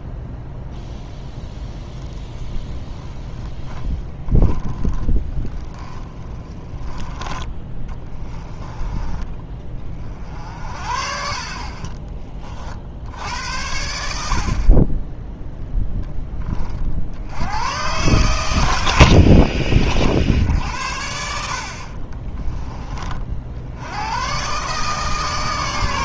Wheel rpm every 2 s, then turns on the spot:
0, 20, 10, 10, 20, 50, 70, 30, 60, 70, 60, 30, 150.
2-6 10-12